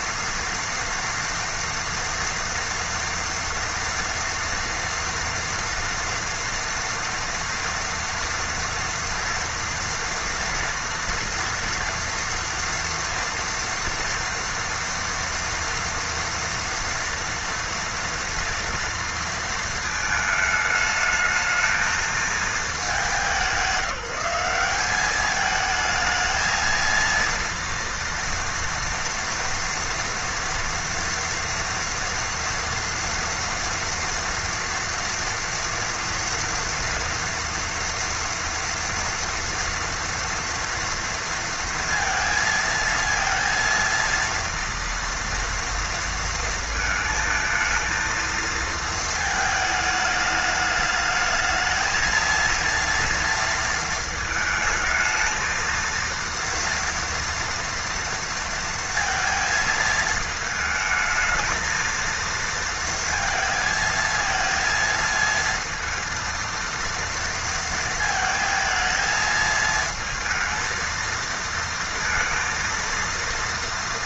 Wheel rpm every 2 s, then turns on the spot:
230, 230, 230, 230, 230, 240, 230, 230, 230, 230, 210, 210, 200, 230, 230, 230, 230, 240, 230, 230, 230, 230, 230, 220, 220, 210, 230, 220, 230, 230, 220, 230, 230, 230, 220, 220, 230.
none